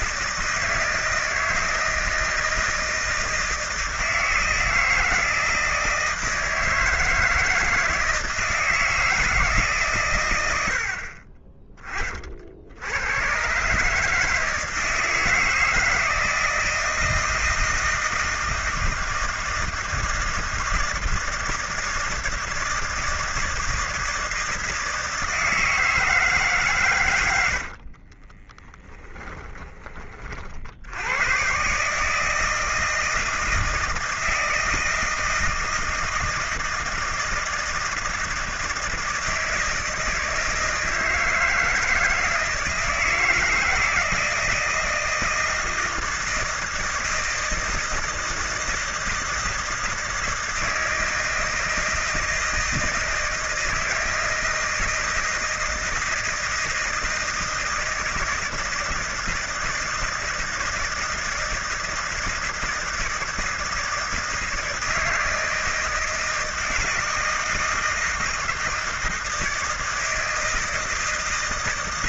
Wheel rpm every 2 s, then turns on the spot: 160, 160, 160, 160, 160, 90, 80, 160, 160, 160, 160, 160, 160, 150, 20, 50, 160, 160, 170, 170, 160, 160, 160, 160, 160, 160, 160, 160, 160, 160, 160, 160, 160, 160, 160, 160.
28-30